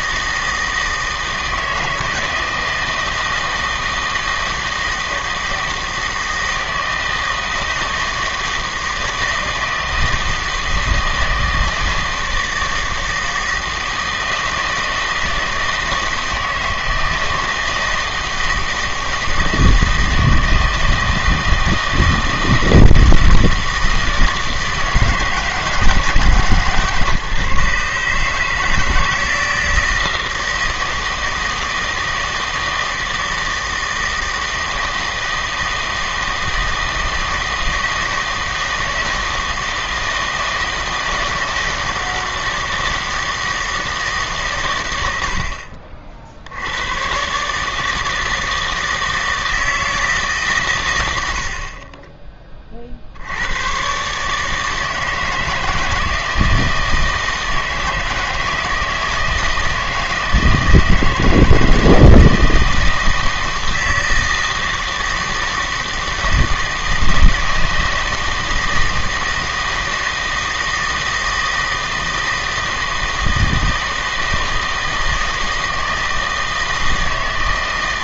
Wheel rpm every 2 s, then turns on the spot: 160, 160, 160, 160, 160, 160, 160, 160, 160, 160, 160, 160, 160, 150, 160, 160, 160, 160, 160, 170, 160, 160, 110, 100, 160, 120, 40, 150, 160, 160, 160, 160, 160, 160, 160, 160, 160, 160, 160.
none